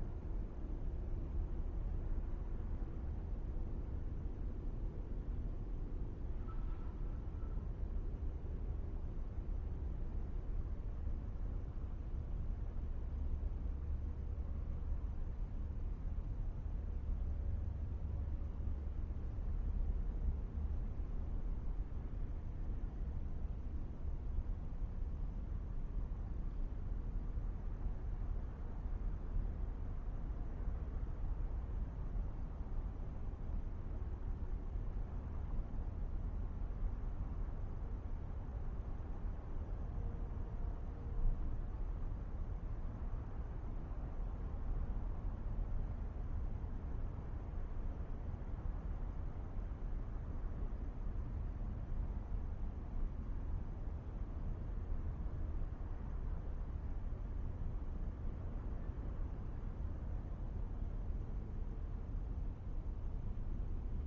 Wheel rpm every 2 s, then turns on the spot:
0, 0, 0, 0, 0, 0, 0, 0, 0, 0, 0, 0, 0, 0, 0, 0, 0, 0, 0, 0, 0, 0, 0, 0, 0, 0, 0, 0, 0, 0, 0, 0.
none